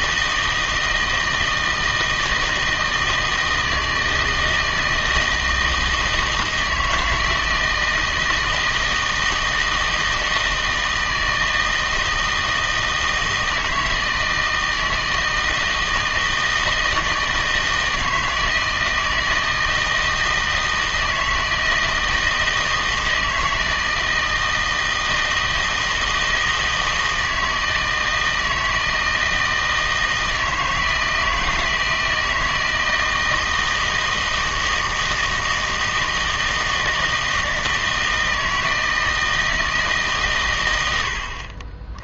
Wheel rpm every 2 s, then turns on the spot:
160, 160, 160, 160, 160, 160, 160, 160, 160, 160, 160, 160, 160, 160, 160, 160, 160, 160, 160, 160, 110.
none